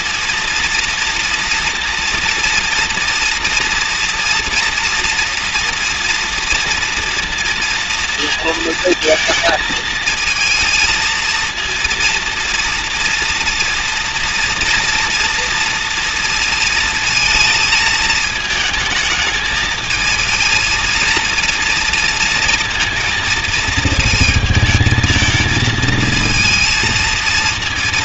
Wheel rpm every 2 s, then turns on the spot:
230, 230, 230, 230, 230, 220, 230, 240, 230, 220, 230, 230, 220, 230.
none